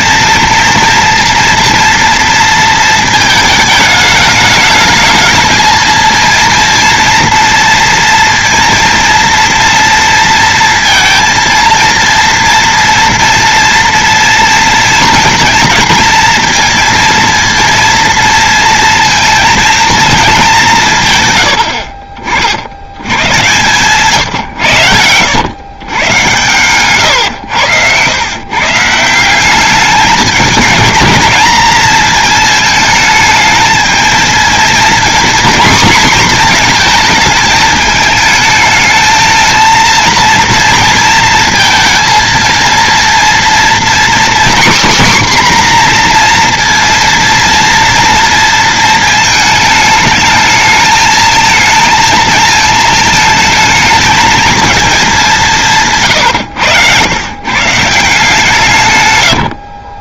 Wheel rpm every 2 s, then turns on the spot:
230, 230, 210, 230, 230, 230, 230, 230, 230, 230, 190, 90, 110, 120, 150, 210, 220, 230, 230, 220, 230, 230, 260, 230, 230, 220, 220, 220, 100, 140.
none